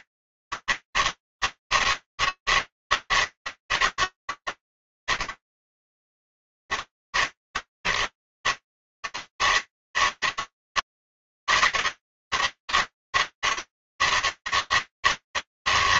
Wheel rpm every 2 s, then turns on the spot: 150, 160, 160, 150, 150, 160, 160, 160.
none